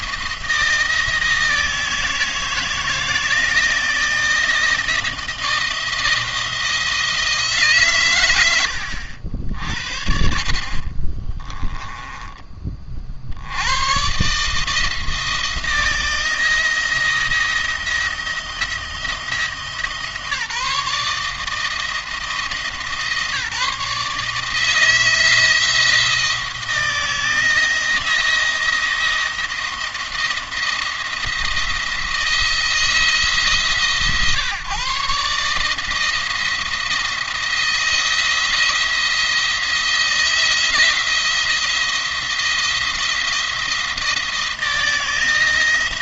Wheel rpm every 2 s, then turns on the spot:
160, 160, 160, 170, 100, 30, 30, 150, 170, 170, 160, 160, 160, 160, 170, 170, 160, 140, 170, 170, 170, 170, 160.
10-12